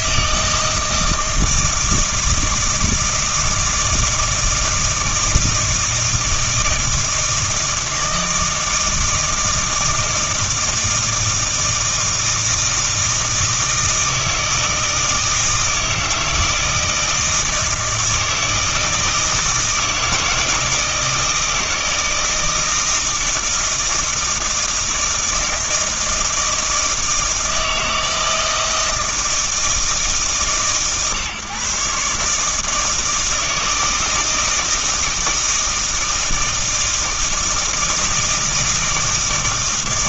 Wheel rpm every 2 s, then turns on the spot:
160, 160, 160, 160, 160, 160, 160, 160, 160, 160, 160, 160, 160, 160, 160, 130, 160, 160, 160, 160.
none